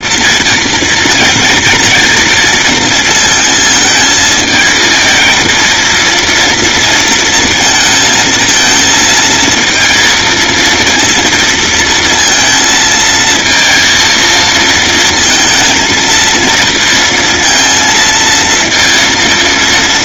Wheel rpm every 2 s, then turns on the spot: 230, 230, 220, 230, 230, 230, 220, 230, 230, 230.
none